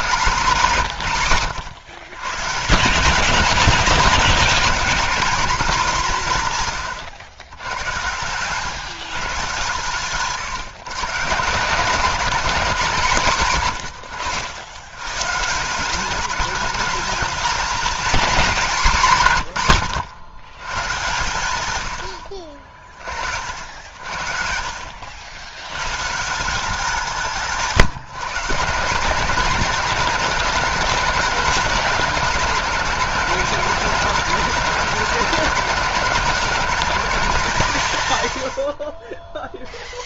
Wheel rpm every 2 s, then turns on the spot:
170, 140, 200, 150, 140, 150, 220, 110, 200, 210, 110, 50, 60, 170, 160, 180, 180, 180, 180, 50.
none